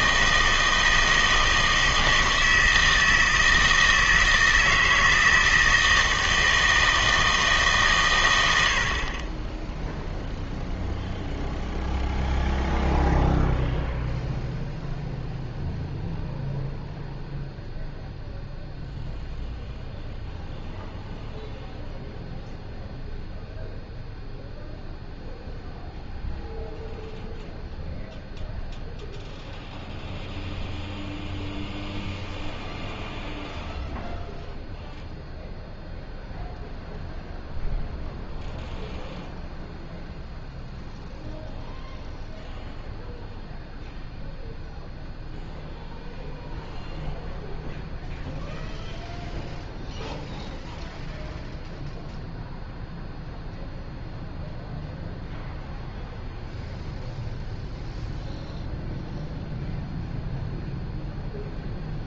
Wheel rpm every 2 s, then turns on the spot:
160, 160, 160, 160, 70, 0, 0, 0, 0, 0, 0, 0, 0, 0, 0, 0, 0, 0, 0, 0, 0, 0, 0, 0, 0, 0, 0, 0, 0, 0, 0.
none